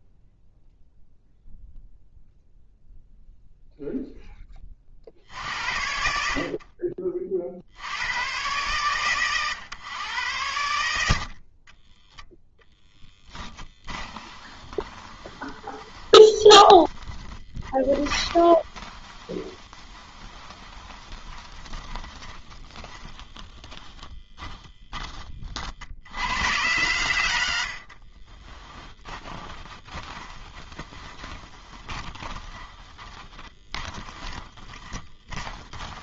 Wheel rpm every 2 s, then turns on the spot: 0, 0, 80, 70, 120, 20, 20, 10, 20, 20, 20, 10, 70, 50, 20, 20, 20, 30.
10-22 26-36